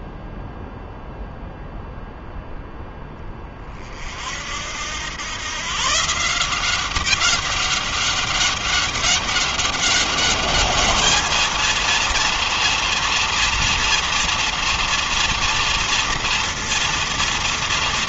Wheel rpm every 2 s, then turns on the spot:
0, 10, 90, 190, 200, 220, 230, 230, 230.
none